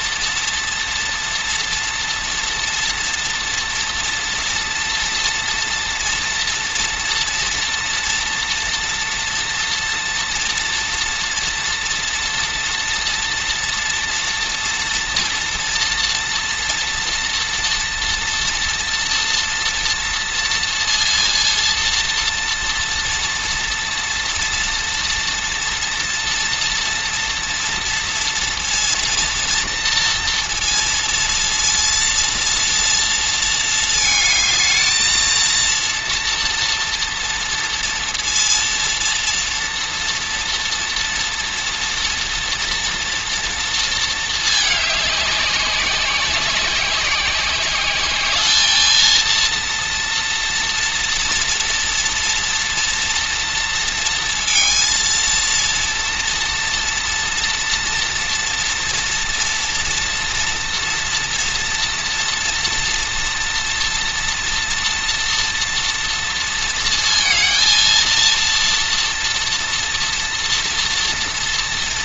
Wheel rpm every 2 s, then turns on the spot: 230, 230, 240, 230, 230, 230, 240, 240, 230, 230, 230, 230, 230, 230, 230, 230, 230, 220, 240, 230, 230, 230, 210, 190, 210, 230, 230, 230, 240, 230, 240, 230, 230, 230, 230, 230.
none